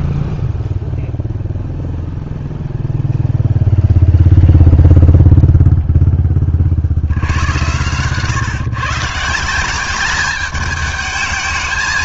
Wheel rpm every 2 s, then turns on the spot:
0, 0, 0, 50, 140, 210.
none